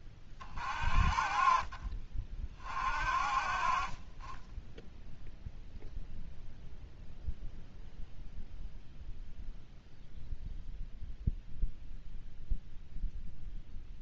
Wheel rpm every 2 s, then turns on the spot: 40, 40, 10, 0, 0, 0, 0.
none